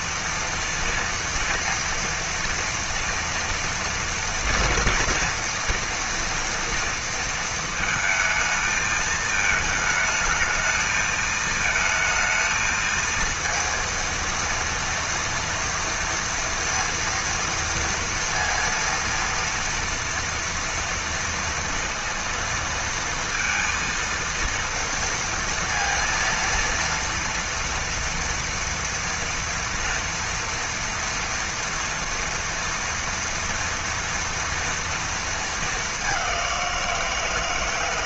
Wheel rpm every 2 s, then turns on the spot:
240, 230, 230, 230, 220, 220, 220, 230, 230, 230, 230, 230, 230, 230, 230, 240, 230, 230, 190.
none